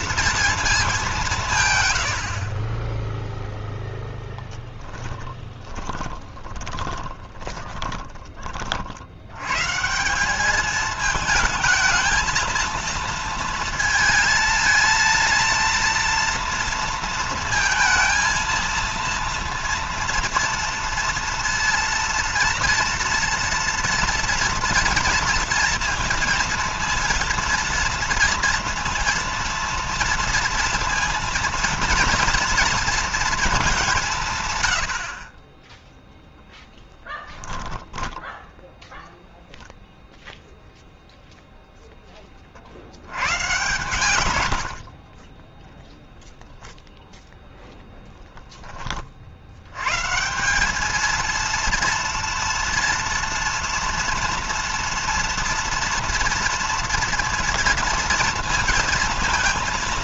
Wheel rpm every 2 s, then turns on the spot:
210, 20, 10, 20, 60, 220, 230, 230, 230, 230, 230, 230, 230, 230, 230, 230, 230, 80, 10, 0, 0, 70, 50, 0, 30, 210, 230, 230, 230, 230.
4-8 34-36 44-46